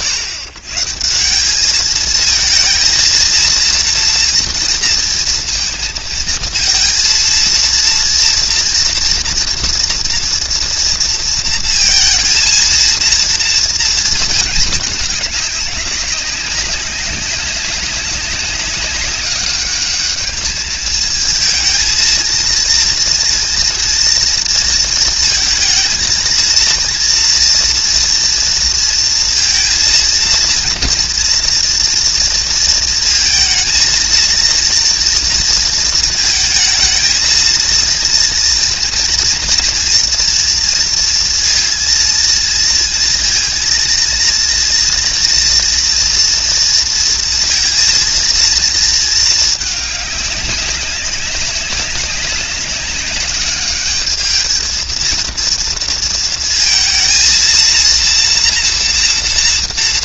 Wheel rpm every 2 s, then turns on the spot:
130, 230, 230, 230, 240, 230, 230, 210, 190, 200, 220, 230, 230, 230, 230, 230, 230, 230, 220, 230, 230, 230, 230, 230, 230, 200, 200, 220, 230, 240.
none